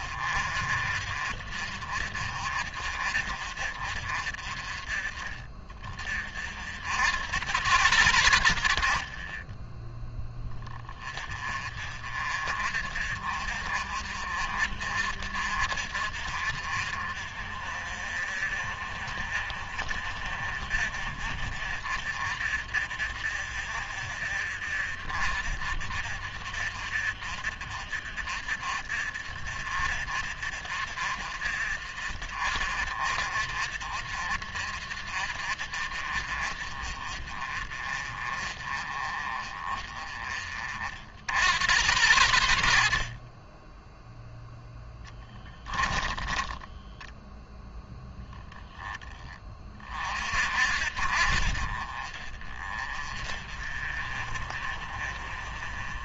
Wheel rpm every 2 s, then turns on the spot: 50, 50, 30, 70, 50, 20, 40, 50, 50, 50, 50, 50, 50, 50, 50, 50, 50, 50, 40, 30, 50, 60, 10, 10, 10, 50, 40, 40.
44-48